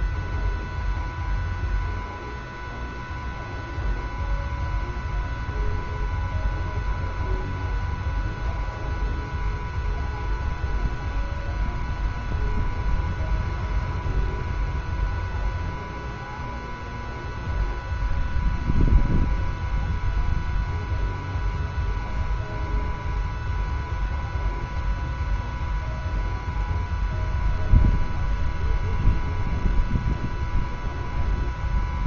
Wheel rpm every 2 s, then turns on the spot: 0, 0, 0, 0, 0, 0, 0, 0, 0, 0, 0, 0, 0, 0, 0, 0.
none